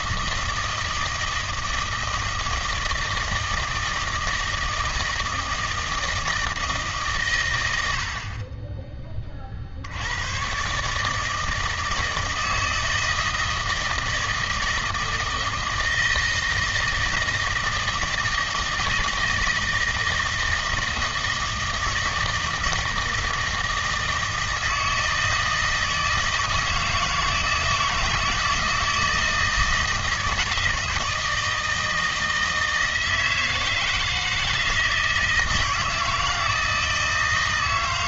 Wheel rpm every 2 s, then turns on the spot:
160, 160, 160, 160, 20, 140, 160, 160, 160, 160, 160, 160, 160, 160, 160, 160, 160, 160, 160.
none